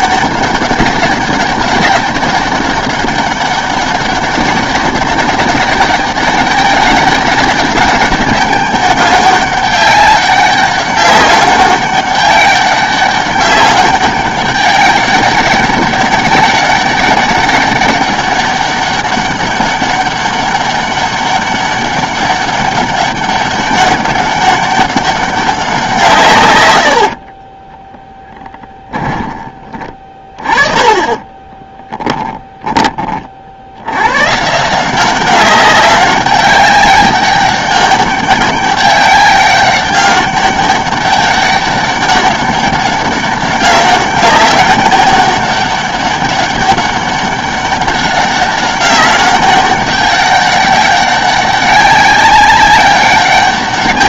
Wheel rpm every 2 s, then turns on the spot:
200, 200, 200, 200, 200, 200, 200, 200, 200, 200, 200, 200, 200, 90, 20, 20, 20, 180, 200, 200, 200, 190, 200, 200, 200, 200, 200.
28-32